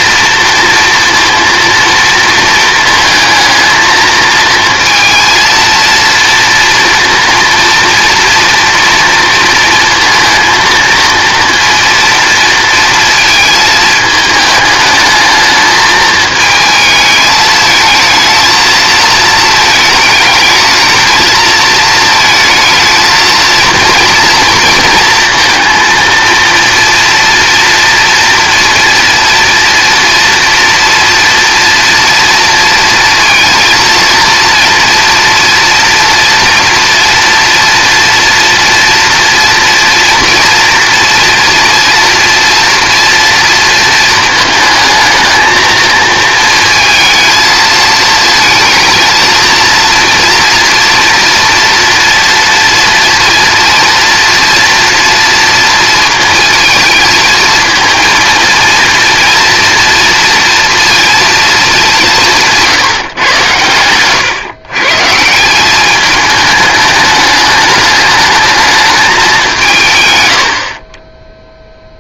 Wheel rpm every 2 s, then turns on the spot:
230, 230, 230, 230, 230, 230, 230, 210, 220, 220, 230, 220, 230, 230, 230, 230, 230, 230, 230, 240, 230, 230, 220, 230, 230, 230, 230, 230, 230, 230, 230, 150, 140, 210, 210, 40.
none